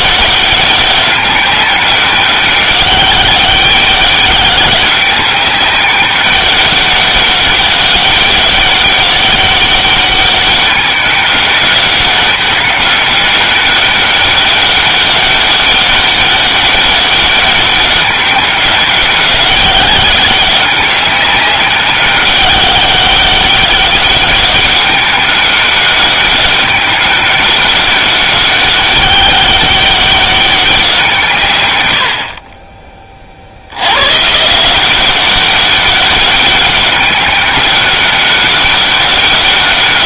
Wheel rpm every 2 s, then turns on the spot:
200, 200, 200, 200, 200, 200, 200, 200, 200, 190, 190, 200, 200, 200, 200, 190, 30, 170, 190, 200.
none